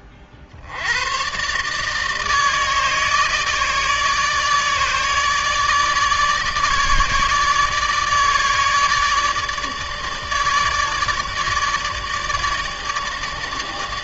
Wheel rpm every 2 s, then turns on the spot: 70, 160, 150, 150, 150, 150, 150.
none